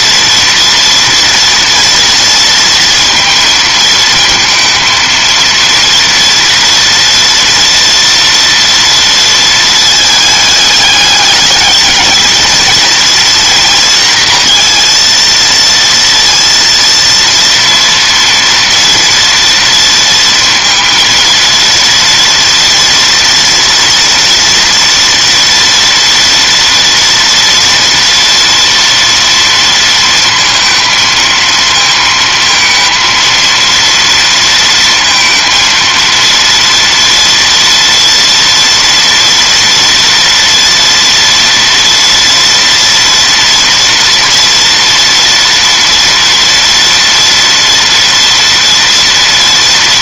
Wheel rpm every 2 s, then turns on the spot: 240, 230, 230, 230, 230, 210, 230, 230, 230, 230, 230, 230, 230, 230, 230, 220, 230, 230, 230, 230, 230, 230, 230, 230, 230.
none